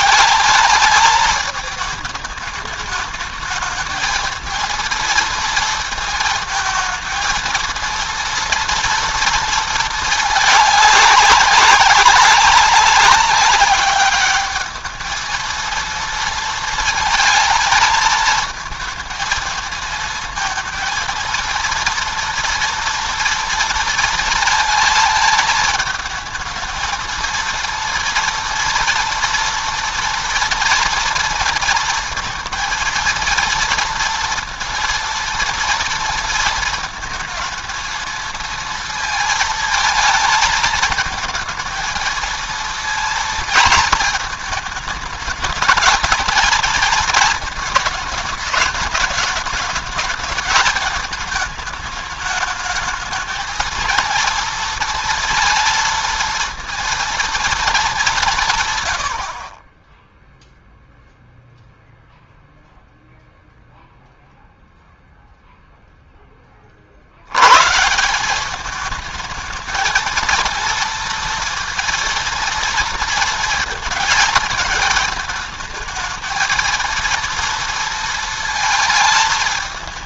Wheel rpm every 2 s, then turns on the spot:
210, 210, 220, 220, 230, 200, 200, 210, 230, 220, 220, 240, 230, 220, 230, 230, 230, 230, 220, 230, 220, 230, 220, 220, 210, 220, 210, 230, 230, 130, 0, 0, 0, 30, 200, 230, 230, 220, 230, 220.
none